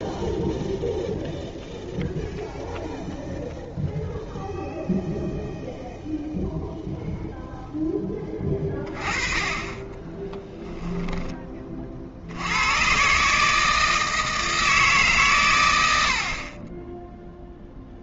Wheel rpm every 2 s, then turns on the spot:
0, 0, 0, 0, 20, 10, 110, 150, 10.
10-12